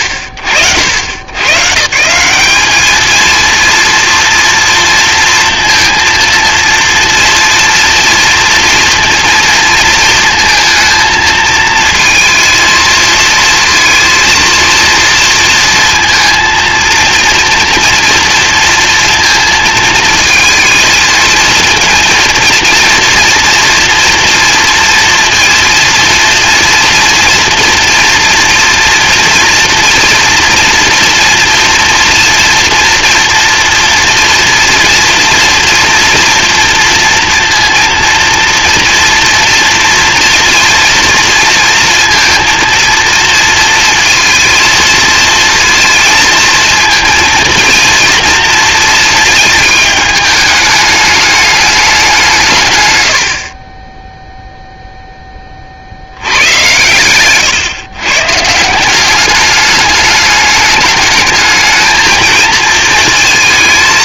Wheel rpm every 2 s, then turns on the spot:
90, 200, 230, 230, 230, 230, 230, 230, 230, 230, 230, 230, 240, 230, 230, 230, 230, 230, 240, 240, 230, 230, 230, 230, 230, 210, 140, 0, 100, 160, 210, 230.
none